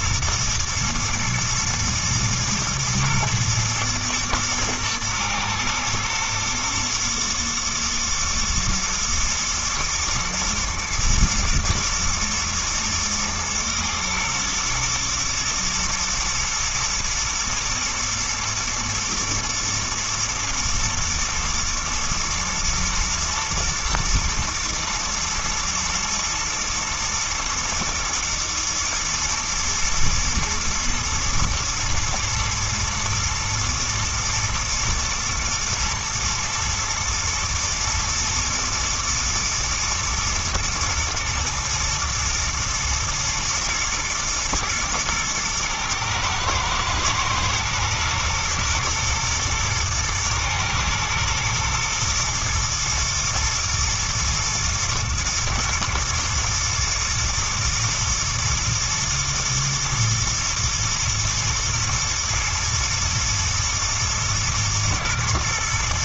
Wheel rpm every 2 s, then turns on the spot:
110, 110, 120, 120, 110, 110, 110, 110, 120, 120, 120, 120, 110, 120, 120, 120, 110, 110, 110, 120, 110, 110, 110, 110, 120, 120, 120, 120, 120, 120, 110, 120, 110.
none